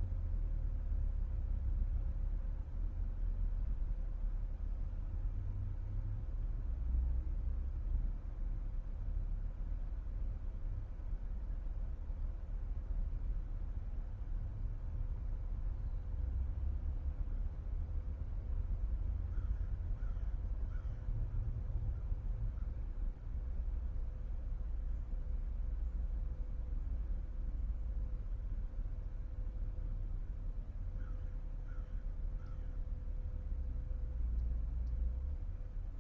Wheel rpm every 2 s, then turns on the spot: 0, 0, 0, 0, 0, 0, 0, 0, 0, 0, 0, 0, 0, 0, 0, 0, 0, 0.
none